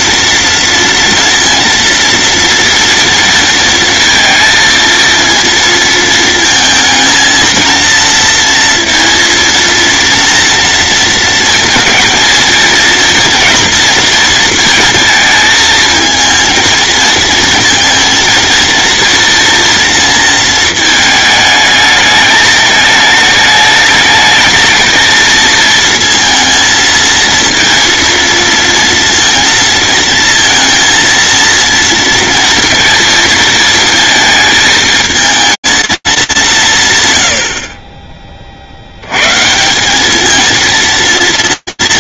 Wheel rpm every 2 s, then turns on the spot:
230, 230, 230, 220, 230, 230, 230, 230, 230, 230, 220, 220, 220, 230, 230, 230, 230, 220, 160, 70, 230.
none